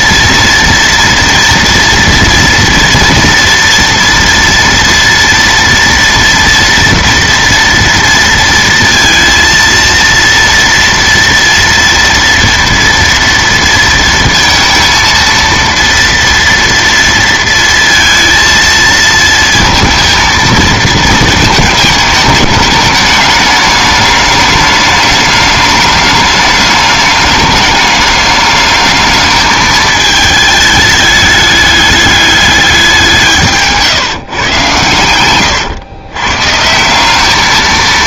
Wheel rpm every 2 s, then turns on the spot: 230, 230, 230, 240, 230, 230, 230, 230, 230, 230, 220, 210, 210, 210, 210, 210, 210, 140, 140.
none